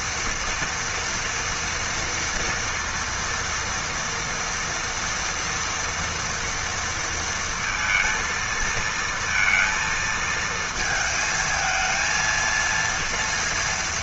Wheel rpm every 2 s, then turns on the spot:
230, 230, 230, 230, 230, 220, 230.
none